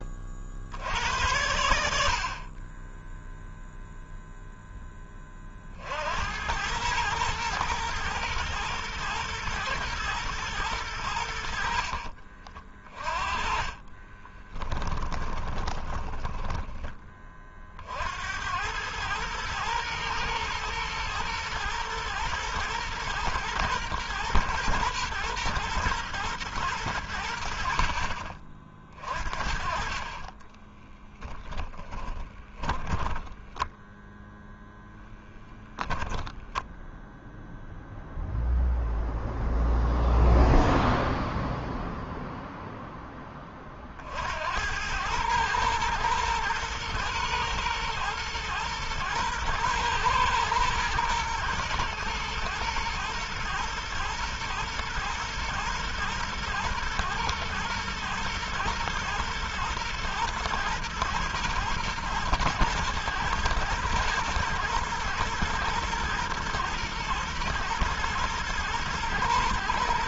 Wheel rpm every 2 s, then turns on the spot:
70, 20, 10, 100, 120, 100, 30, 20, 20, 100, 110, 110, 110, 100, 50, 20, 20, 0, 0, 0, 0, 10, 90, 120, 110, 120, 110, 110, 120, 110, 120, 110, 120, 110, 110.
14-16 30-34